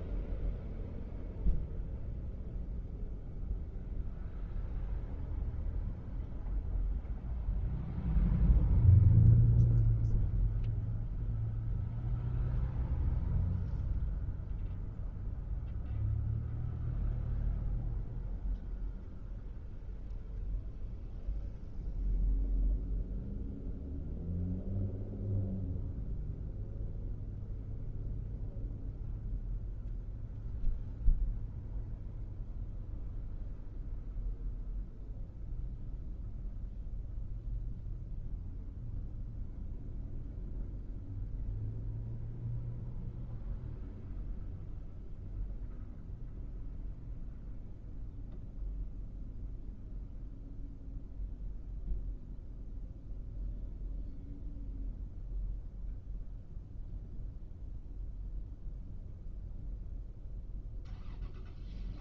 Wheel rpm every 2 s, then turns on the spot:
0, 0, 0, 0, 0, 0, 0, 0, 0, 0, 0, 0, 0, 0, 0, 0, 0, 0, 0, 0, 0, 0, 0, 0, 0, 0, 0, 0, 0, 0, 0.
none